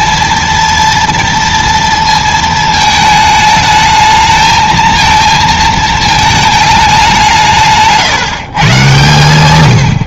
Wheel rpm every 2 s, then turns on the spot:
230, 220, 220, 200, 140.
none